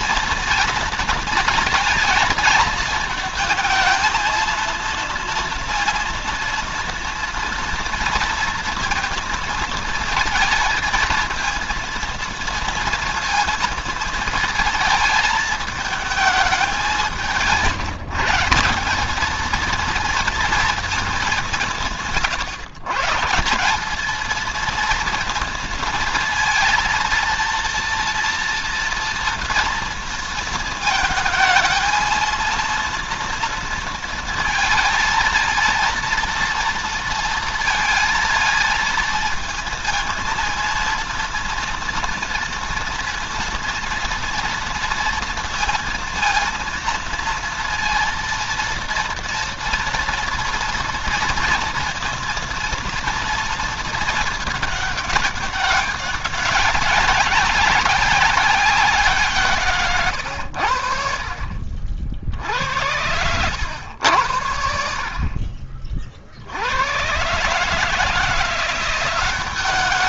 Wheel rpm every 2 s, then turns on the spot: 230, 220, 230, 230, 230, 230, 230, 220, 180, 190, 210, 140, 230, 230, 230, 220, 230, 230, 230, 230, 230, 230, 230, 230, 230, 230, 230, 200, 200, 180, 70, 90, 60, 90, 180.
none